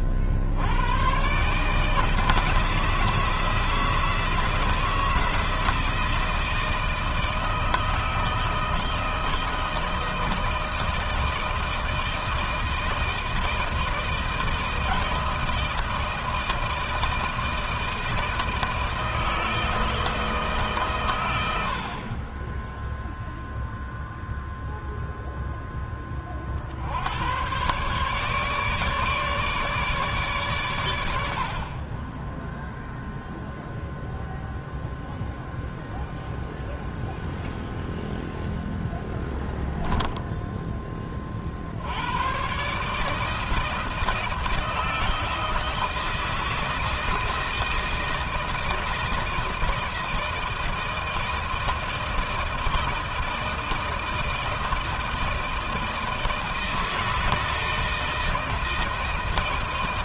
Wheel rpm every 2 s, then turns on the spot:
60, 160, 160, 160, 160, 160, 160, 160, 160, 160, 150, 20, 0, 40, 150, 130, 10, 0, 0, 0, 10, 120, 160, 160, 160, 160, 160, 160, 160, 160.
none